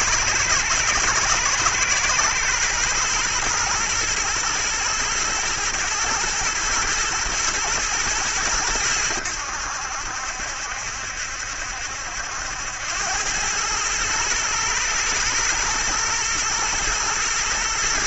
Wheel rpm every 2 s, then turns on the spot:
110, 120, 110, 120, 100, 70, 90, 110, 120.
none